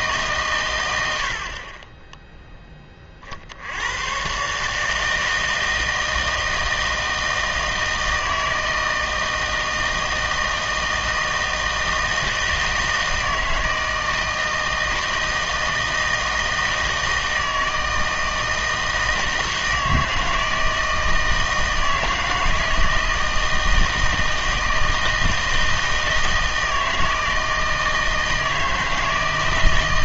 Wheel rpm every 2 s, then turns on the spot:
120, 10, 140, 160, 160, 160, 160, 160, 160, 160, 160, 160, 160, 160, 160.
none